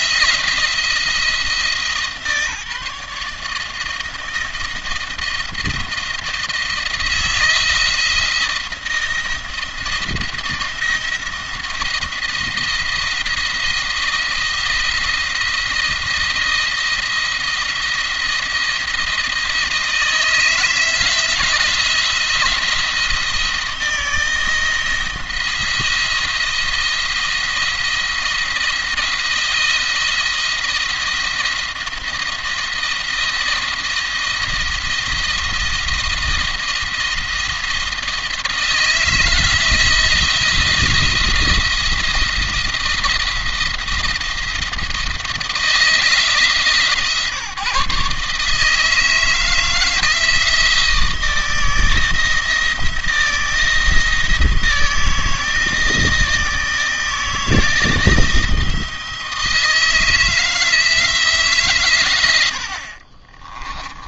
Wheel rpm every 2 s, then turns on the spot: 170, 150, 160, 170, 170, 170, 170, 170, 170, 170, 170, 170, 170, 170, 170, 170, 170, 170, 170, 160, 170, 170, 170, 150, 150, 160, 160, 160, 160, 160, 160, 50.
62-64